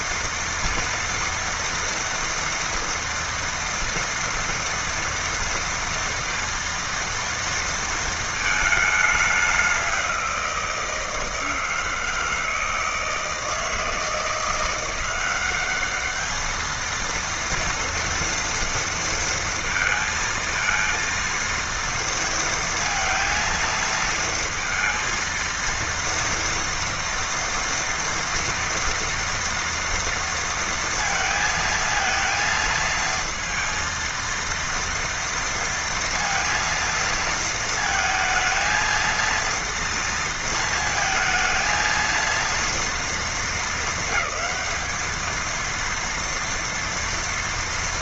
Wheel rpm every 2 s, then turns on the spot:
230, 230, 240, 230, 220, 180, 160, 160, 210, 230, 230, 230, 230, 230, 230, 230, 230, 230, 230, 220, 230, 230, 200, 230.
none